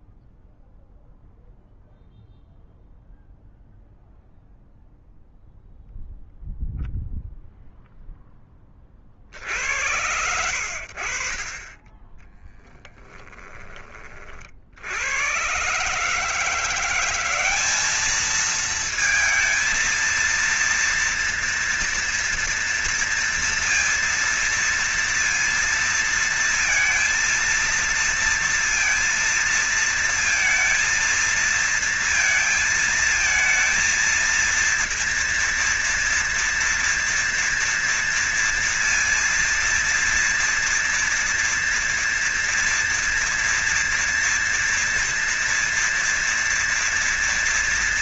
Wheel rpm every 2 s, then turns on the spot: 0, 0, 0, 0, 10, 80, 20, 50, 160, 220, 230, 230, 230, 230, 230, 230, 230, 230, 230, 230, 230, 230, 230, 230.
12-14